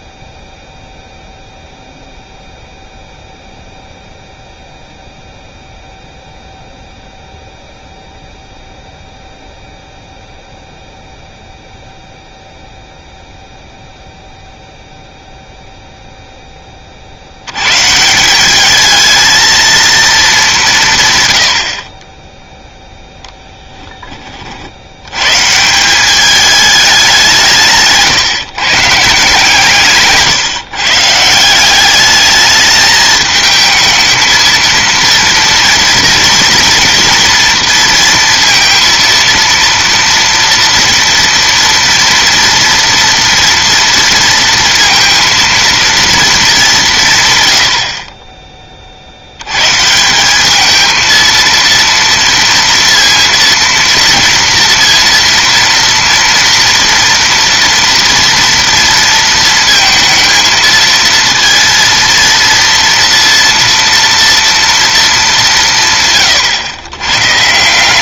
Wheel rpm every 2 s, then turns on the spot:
0, 0, 0, 0, 0, 0, 0, 0, 20, 200, 180, 0, 60, 210, 150, 150, 210, 230, 230, 230, 230, 230, 230, 190, 30, 210, 230, 230, 240, 230, 230, 230, 230, 110.
none